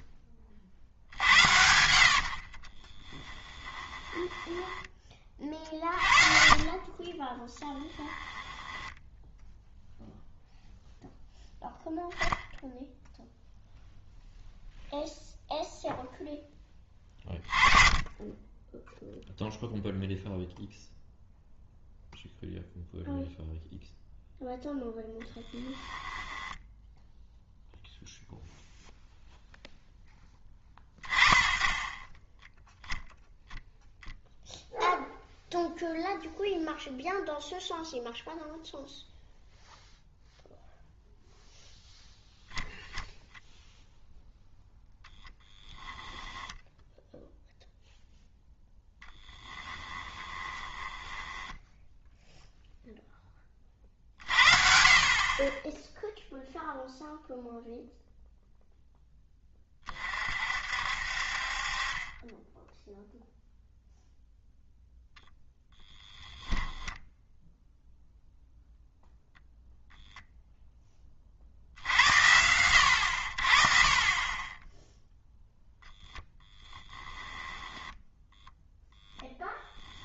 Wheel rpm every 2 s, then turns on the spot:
50, 30, 10, 40, 10, 0, 0, 0, 10, 10, 0, 0, 0, 10, 0, 10, 0, 0, 0, 0, 0, 0, 0, 10, 10, 20, 0, 50, 0, 0, 50, 10, 0, 0, 0, 10, 80, 10, 10, 0.
2-6 8-10 26-28 48-52